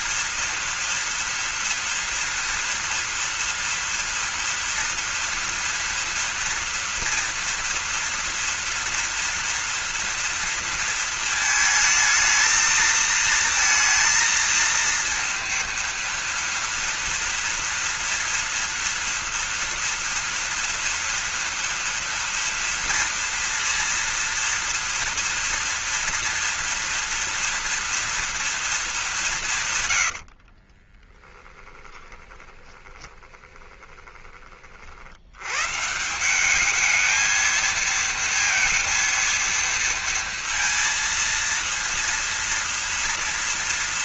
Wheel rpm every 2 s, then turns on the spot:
230, 240, 230, 240, 240, 230, 220, 230, 230, 240, 230, 240, 230, 230, 230, 70, 20, 30, 190, 230, 230, 230.
30-34